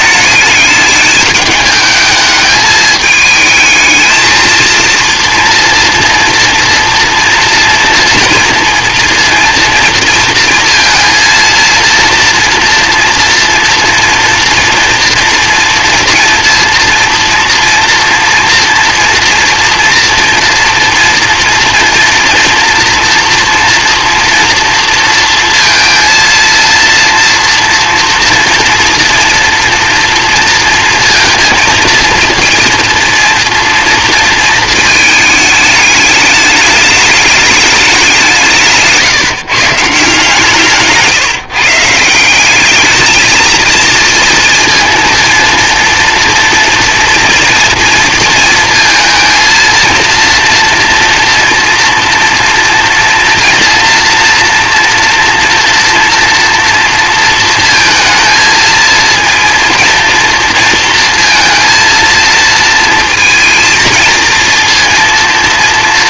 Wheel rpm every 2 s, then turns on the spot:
210, 210, 230, 230, 230, 230, 230, 240, 230, 230, 230, 230, 230, 230, 230, 230, 230, 230, 210, 160, 160, 200, 230, 230, 230, 230, 230, 230, 240, 230, 230, 230, 230.
none